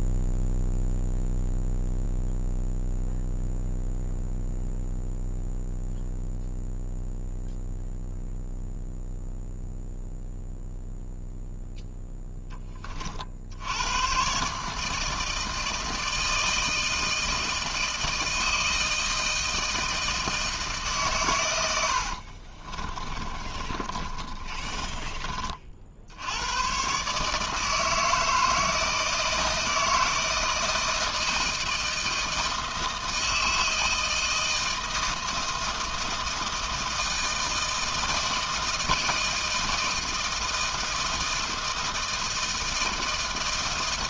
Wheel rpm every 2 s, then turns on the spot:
0, 0, 0, 0, 0, 0, 20, 150, 160, 160, 150, 30, 20, 120, 160, 160, 160, 160, 160, 160, 160, 160.
22-26